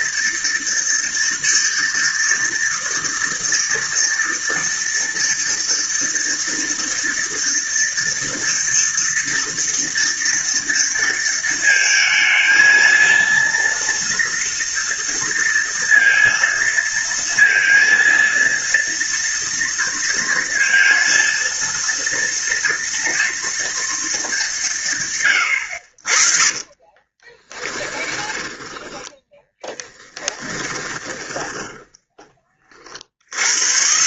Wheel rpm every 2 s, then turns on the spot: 230, 230, 230, 230, 230, 230, 220, 230, 230, 230, 230, 230, 200, 40, 20, 20, 20.
26-32